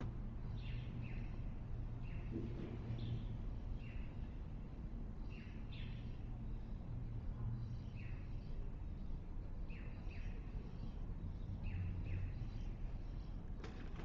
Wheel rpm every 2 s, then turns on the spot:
0, 0, 0, 0, 0, 0, 0.
none